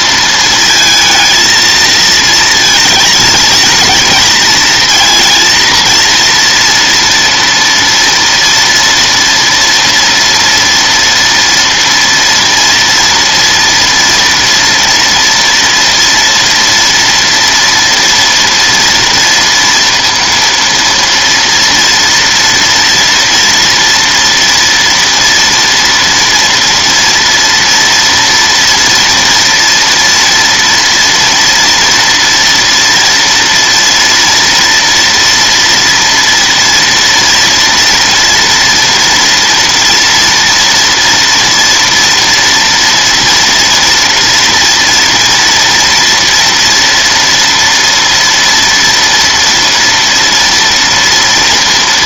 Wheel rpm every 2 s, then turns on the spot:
230, 220, 220, 230, 230, 230, 230, 240, 230, 230, 230, 230, 230, 230, 230, 240, 230, 230, 230, 230, 230, 230, 230, 230, 240, 230.
none